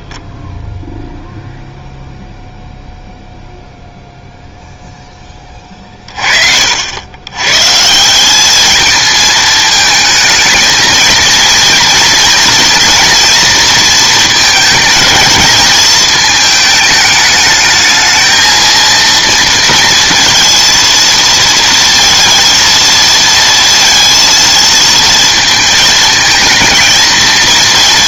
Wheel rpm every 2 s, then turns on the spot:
0, 0, 0, 80, 220, 230, 230, 220, 220, 230, 230, 230, 230, 230.
none